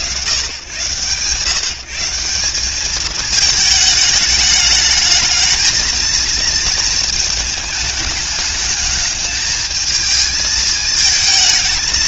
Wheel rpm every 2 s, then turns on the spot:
180, 220, 230, 210, 220, 230.
none